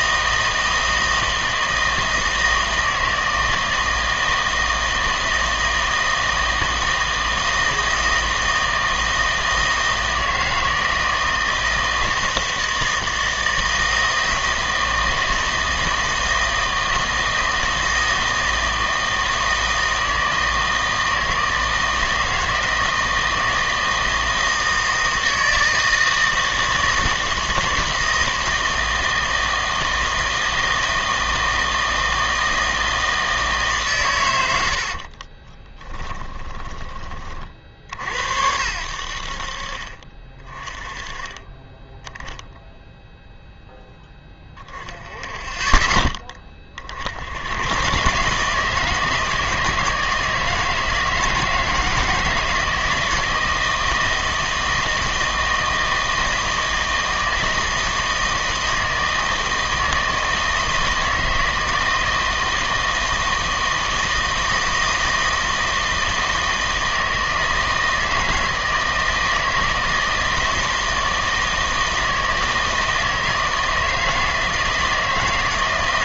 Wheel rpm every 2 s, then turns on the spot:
160, 160, 160, 160, 160, 160, 160, 160, 160, 160, 160, 160, 160, 160, 160, 160, 160, 80, 20, 80, 20, 0, 10, 50, 160, 160, 160, 160, 160, 160, 160, 160, 160, 160, 160, 160, 160, 160.
34-38